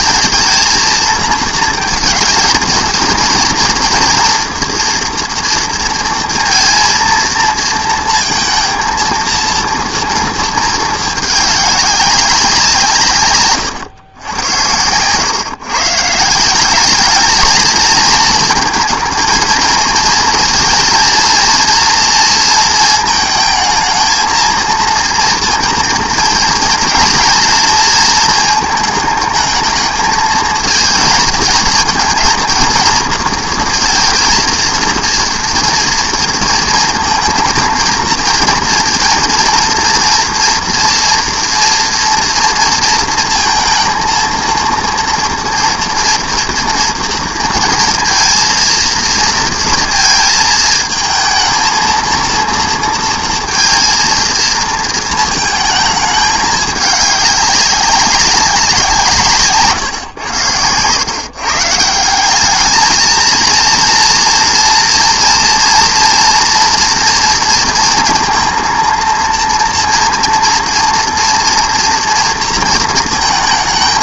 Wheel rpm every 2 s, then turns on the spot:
220, 220, 230, 230, 230, 220, 180, 100, 190, 230, 230, 230, 230, 240, 220, 230, 230, 230, 230, 230, 230, 230, 230, 230, 230, 230, 230, 230, 210, 180, 90, 210, 240, 240, 230, 230, 230.
none